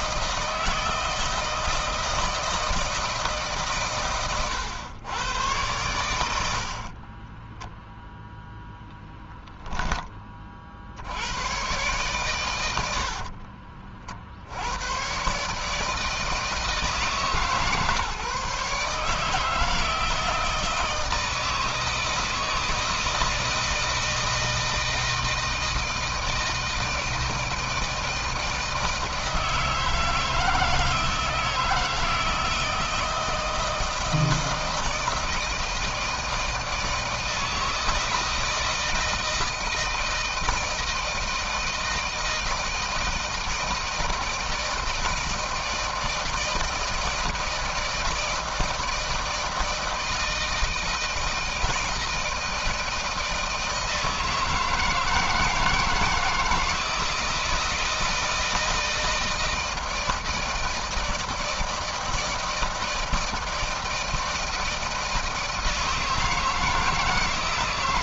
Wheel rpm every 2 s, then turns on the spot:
160, 160, 110, 40, 0, 70, 60, 110, 160, 150, 160, 160, 160, 160, 160, 160, 160, 160, 160, 160, 160, 160, 160, 160, 160, 160, 160, 170, 170, 160, 160, 160, 160, 160.
6-8 12-14